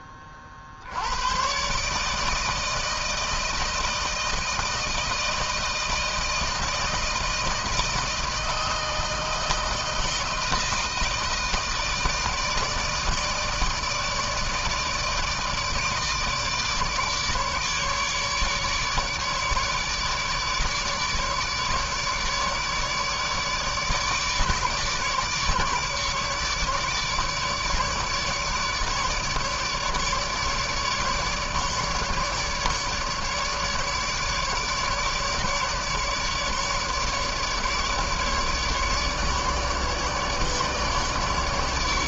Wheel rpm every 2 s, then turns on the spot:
40, 160, 160, 160, 160, 160, 160, 160, 160, 150, 150, 150, 150, 150, 150, 150, 150, 150, 150, 150, 150.
none